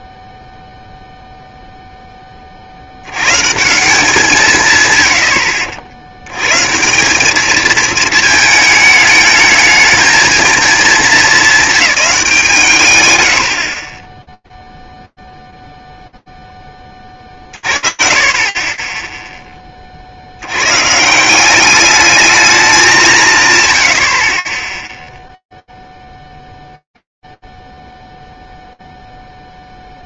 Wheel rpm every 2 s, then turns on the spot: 0, 90, 120, 180, 220, 210, 110, 0, 40, 10, 170, 150, 0, 0, 0.
none